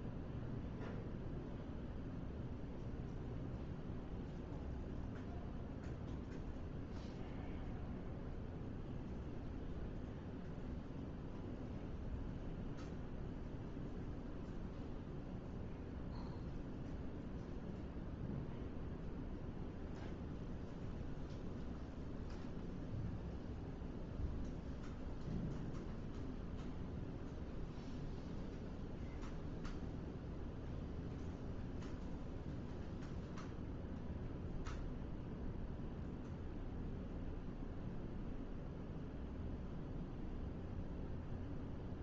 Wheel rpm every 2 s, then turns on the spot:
0, 0, 0, 0, 0, 0, 0, 0, 0, 0, 0, 0, 0, 0, 0, 0, 0, 0, 0, 0, 0.
none